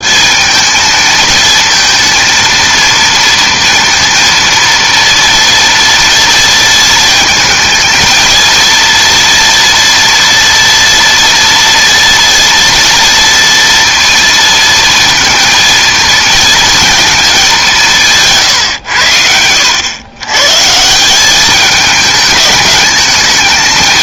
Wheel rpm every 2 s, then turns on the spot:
220, 230, 230, 230, 230, 240, 240, 230, 230, 110, 160, 210.
none